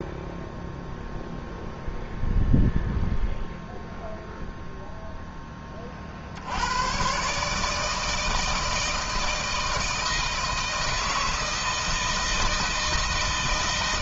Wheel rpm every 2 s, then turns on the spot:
0, 0, 0, 110, 160, 160, 160.
none